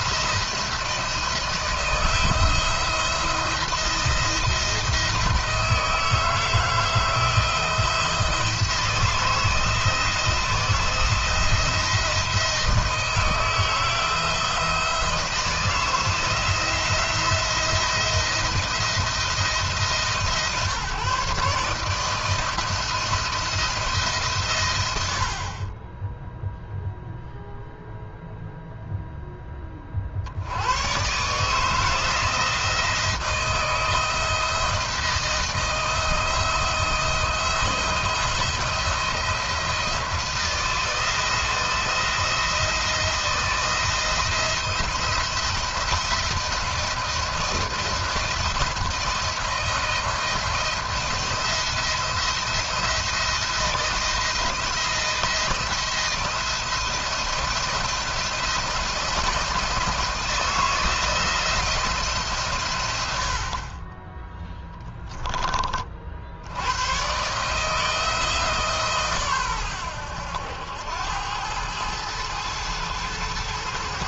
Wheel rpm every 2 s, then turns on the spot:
170, 170, 170, 160, 170, 160, 160, 170, 170, 170, 140, 160, 120, 0, 0, 90, 170, 160, 160, 170, 170, 160, 170, 170, 160, 170, 170, 170, 170, 170, 160, 120, 10, 90, 150, 90, 110.
none